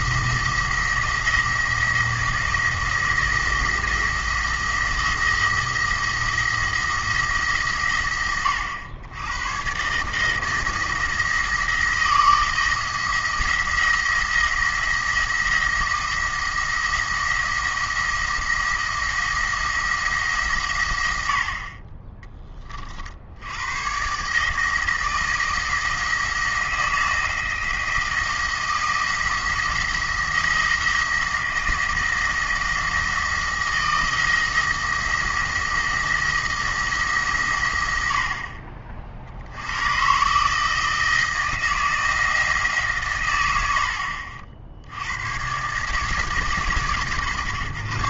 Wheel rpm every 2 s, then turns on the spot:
170, 160, 170, 170, 100, 160, 170, 170, 170, 170, 120, 30, 160, 160, 170, 170, 170, 170, 160, 50, 160, 160, 60, 140.
none